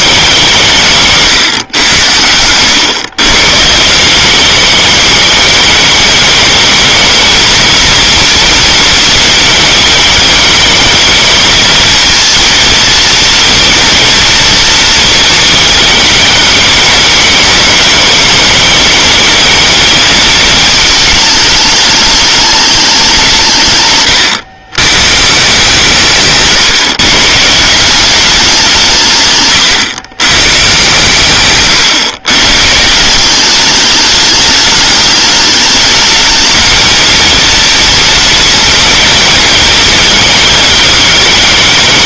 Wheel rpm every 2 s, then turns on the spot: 190, 100, 200, 220, 230, 220, 230, 230, 210, 220, 220, 210, 110, 140, 190, 120, 140, 210, 220, 230, 220.
26-28